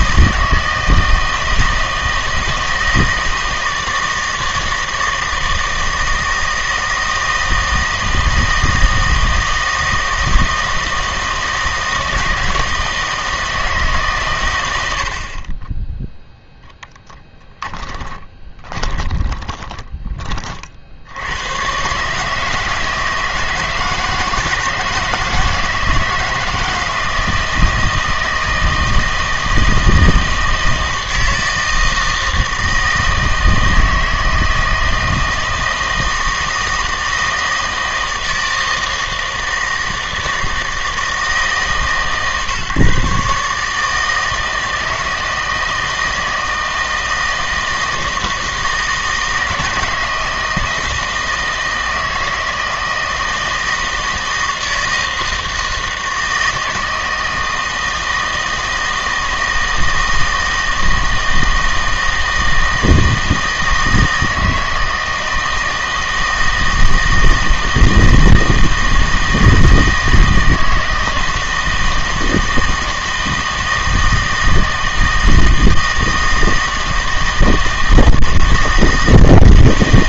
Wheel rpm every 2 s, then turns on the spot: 160, 160, 160, 160, 160, 160, 160, 110, 0, 20, 40, 150, 160, 160, 160, 160, 160, 160, 160, 160, 160, 140, 160, 160, 160, 160, 160, 160, 160, 160, 160, 160, 160, 160, 160, 160, 170, 160, 160, 160.
18-20